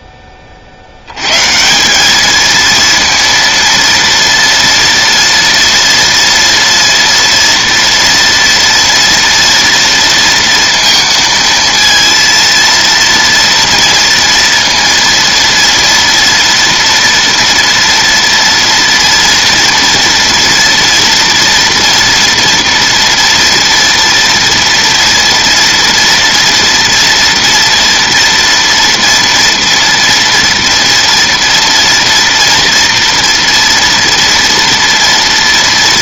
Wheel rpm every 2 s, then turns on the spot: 60, 230, 230, 230, 230, 230, 230, 230, 230, 230, 230, 230, 230, 230, 230, 230, 230, 240.
none